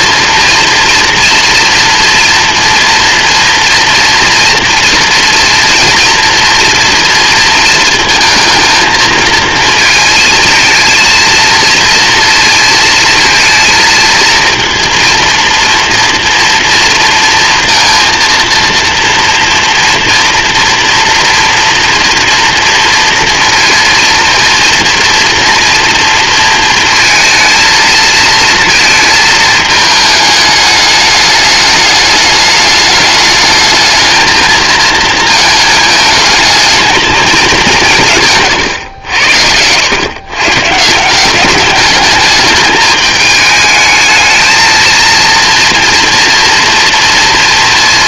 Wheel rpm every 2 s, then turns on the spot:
230, 230, 240, 230, 220, 230, 230, 230, 240, 230, 240, 230, 230, 230, 220, 210, 210, 220, 220, 90, 180, 210, 230, 230.
none